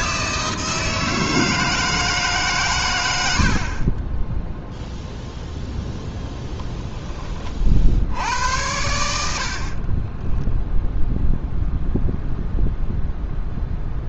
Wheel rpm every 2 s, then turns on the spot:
160, 120, 0, 10, 80, 0, 0.
none